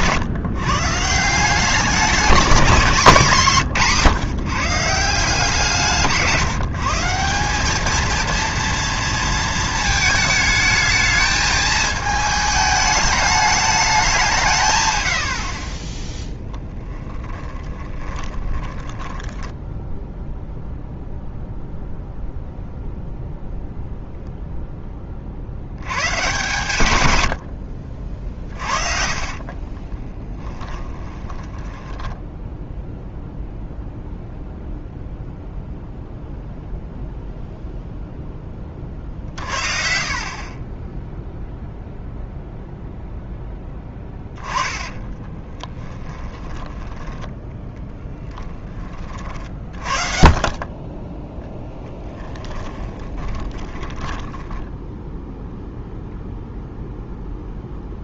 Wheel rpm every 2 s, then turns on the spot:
130, 200, 150, 160, 230, 220, 220, 140, 10, 10, 0, 0, 10, 130, 40, 10, 0, 0, 0, 30, 20, 0, 20, 10, 20, 20, 20, 10, 0.
16-20 28-32 44-48 52-56